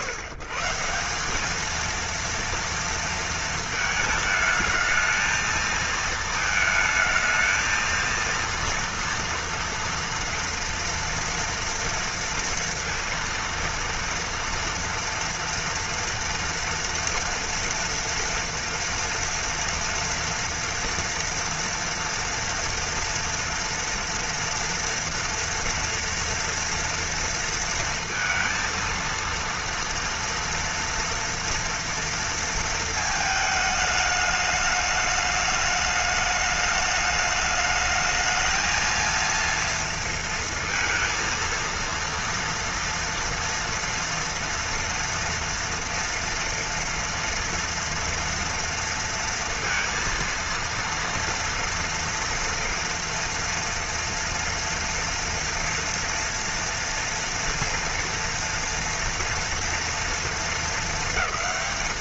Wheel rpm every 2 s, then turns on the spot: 140, 230, 220, 220, 230, 230, 230, 230, 230, 230, 230, 230, 230, 240, 230, 230, 230, 210, 210, 220, 230, 230, 230, 230, 230, 230, 230, 230, 230, 230, 220.
none